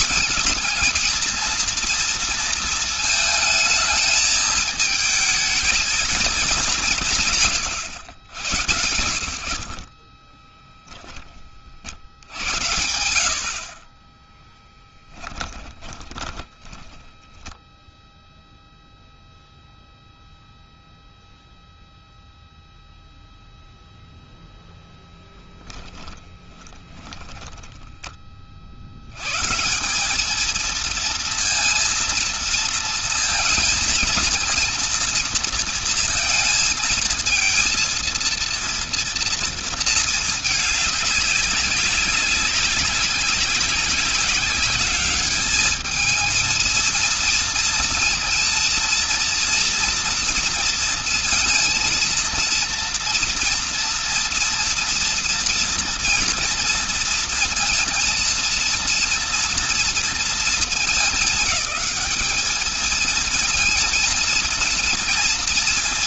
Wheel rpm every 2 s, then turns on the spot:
220, 230, 220, 210, 90, 30, 70, 10, 10, 0, 0, 0, 0, 20, 20, 210, 230, 230, 230, 230, 210, 190, 200, 230, 230, 230, 230, 240, 230, 230, 230, 210, 230.
10-12 14-18 26-28